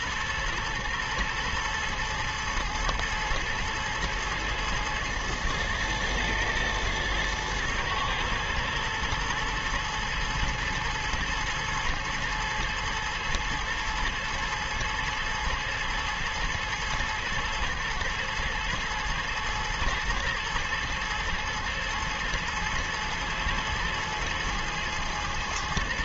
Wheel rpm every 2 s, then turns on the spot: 120, 110, 110, 110, 110, 110, 110, 110, 110, 110, 110, 110, 110.
none